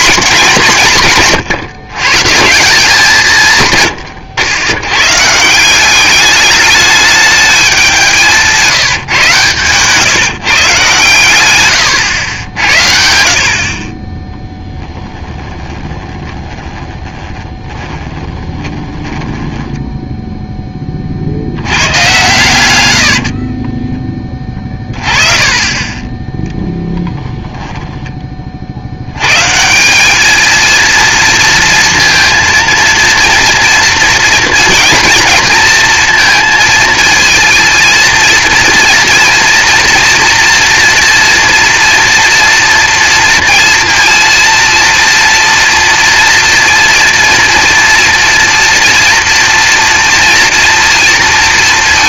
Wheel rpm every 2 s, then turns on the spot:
150, 180, 100, 210, 160, 120, 80, 10, 20, 20, 10, 100, 20, 0, 30, 220, 230, 240, 230, 230, 230, 230, 230, 240, 240, 230.
14-20 24-26